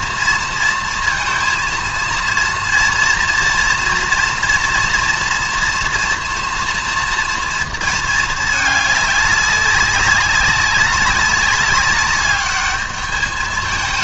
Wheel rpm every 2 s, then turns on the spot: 230, 230, 230, 240, 210, 200, 200.
none